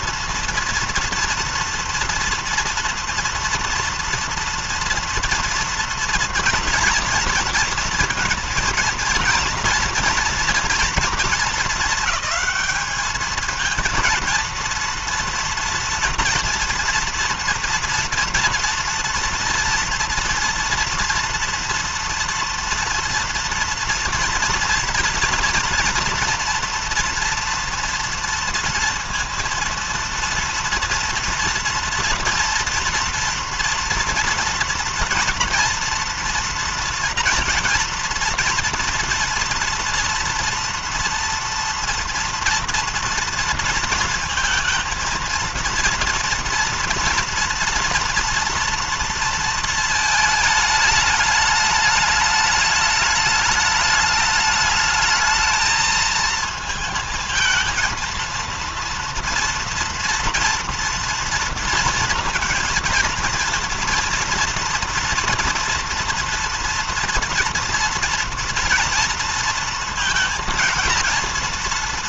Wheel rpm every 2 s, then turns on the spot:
230, 230, 230, 230, 230, 230, 210, 230, 230, 230, 230, 230, 230, 240, 230, 230, 230, 230, 230, 230, 230, 230, 230, 230, 230, 220, 210, 210, 220, 230, 230, 230, 230, 230, 230, 230.
none